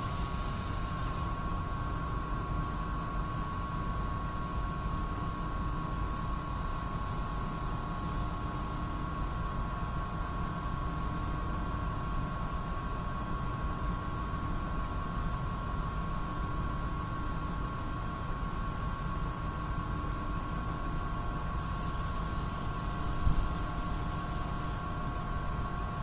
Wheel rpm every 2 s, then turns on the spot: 0, 0, 0, 0, 0, 0, 0, 0, 0, 0, 0, 0, 0.
none